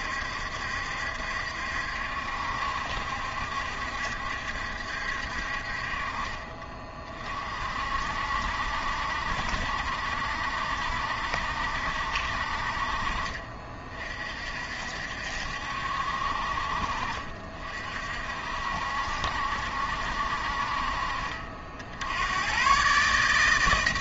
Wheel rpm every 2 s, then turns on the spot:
70, 70, 60, 40, 60, 70, 50, 60, 50, 60, 50, 130.
none